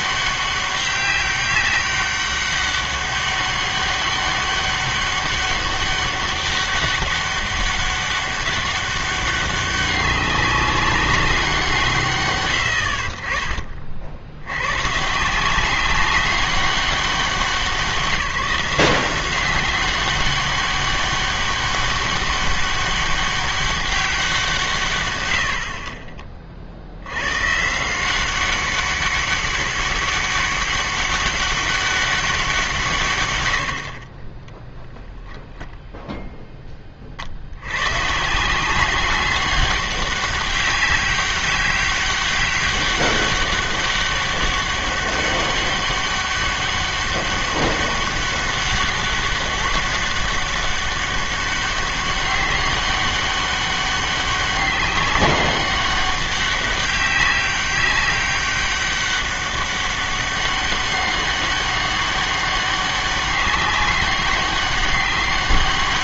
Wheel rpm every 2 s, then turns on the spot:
200, 200, 200, 200, 200, 200, 90, 100, 200, 180, 200, 200, 160, 50, 190, 200, 170, 10, 10, 180, 200, 200, 200, 200, 200, 200, 200, 200, 200, 200, 200, 200, 200.
none